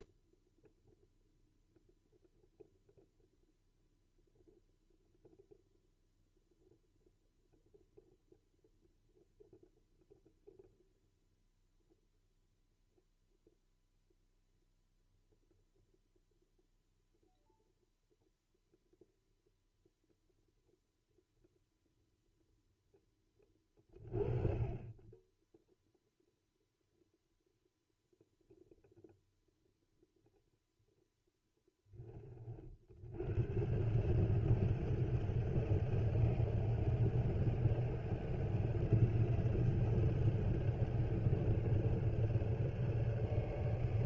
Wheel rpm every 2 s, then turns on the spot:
0, 0, 0, 0, 0, 0, 0, 0, 0, 0, 0, 0, 20, 0, 0, 0, 50, 150, 160, 160, 160, 150.
none